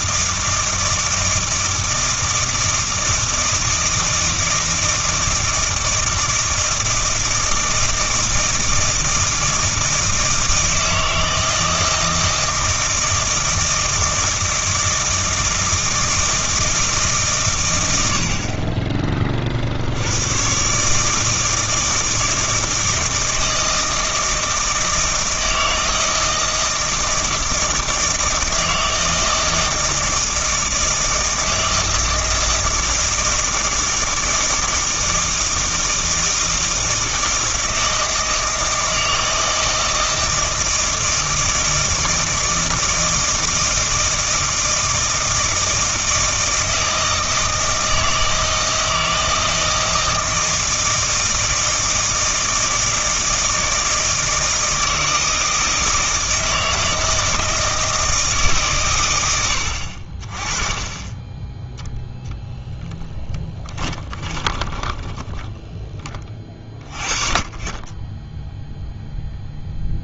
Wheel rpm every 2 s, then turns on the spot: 160, 160, 160, 160, 160, 160, 160, 160, 160, 50, 110, 160, 160, 160, 160, 160, 160, 160, 160, 160, 160, 160, 160, 160, 160, 160, 160, 160, 160, 150, 30, 0, 10, 30, 10.
64-66